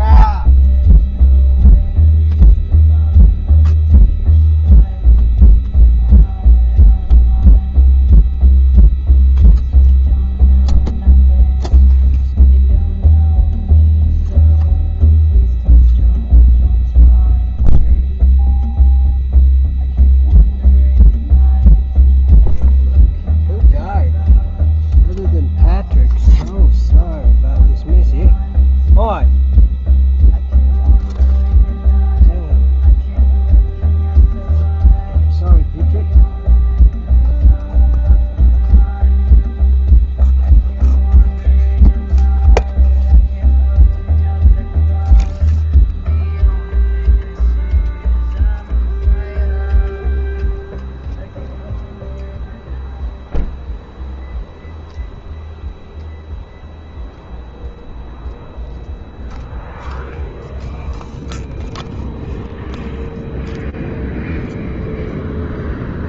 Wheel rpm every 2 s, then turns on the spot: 0, 0, 0, 0, 0, 0, 0, 0, 0, 0, 0, 0, 0, 0, 0, 0, 0, 0, 0, 0, 0, 0, 0, 0, 0, 0, 0, 0, 0, 0, 0, 0, 0.
none